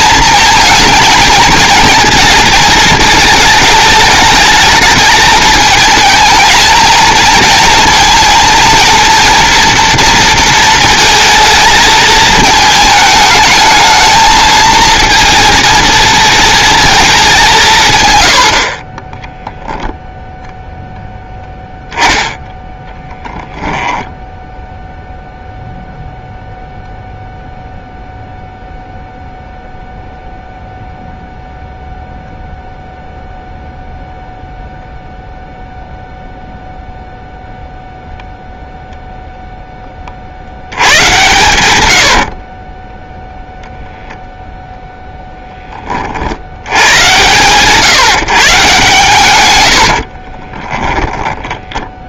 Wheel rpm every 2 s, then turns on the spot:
220, 220, 220, 220, 230, 230, 220, 230, 220, 30, 0, 10, 0, 0, 0, 0, 0, 0, 0, 0, 80, 20, 0, 100, 140, 10.
40-44 50-52